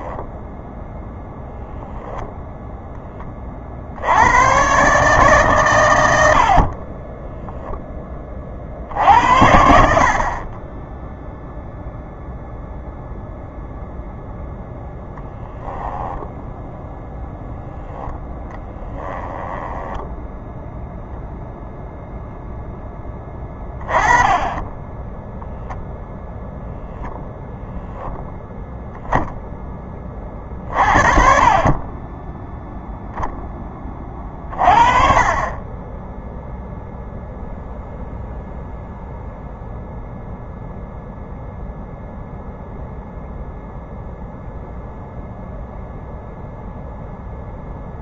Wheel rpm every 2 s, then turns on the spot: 0, 0, 130, 40, 50, 10, 0, 0, 0, 10, 0, 10, 10, 0, 10, 40, 0, 30, 0, 0, 0, 0, 0, 0.
18-20